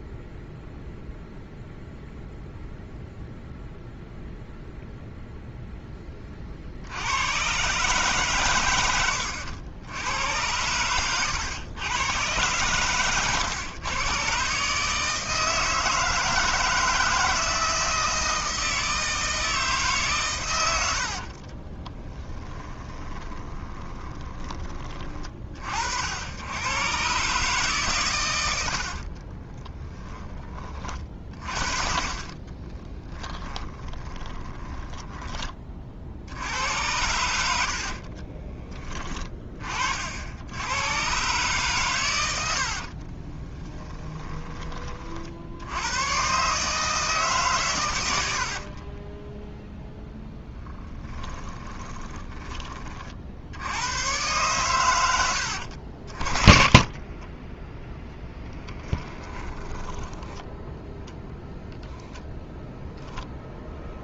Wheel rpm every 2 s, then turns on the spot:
0, 0, 0, 70, 100, 110, 110, 150, 160, 160, 90, 20, 40, 120, 70, 30, 20, 20, 90, 20, 110, 50, 40, 150, 40, 20, 40, 120, 30, 10, 10, 0.
20-24 28-30 32-36 42-44 48-52 56-58 60-62